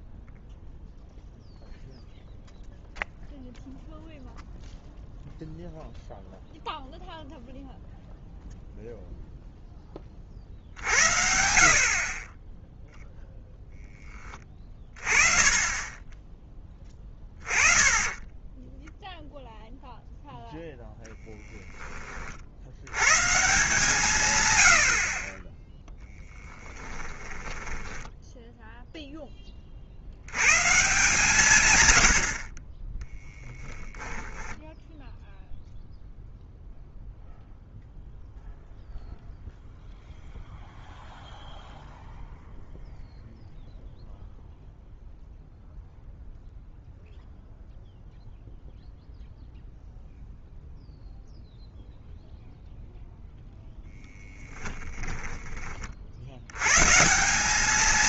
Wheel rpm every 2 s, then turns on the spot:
0, 0, 0, 0, 0, 50, 10, 30, 10, 10, 0, 70, 100, 10, 0, 130, 30, 0, 0, 0, 0, 0, 0, 0, 0, 0, 0, 10, 110.
26-28 54-56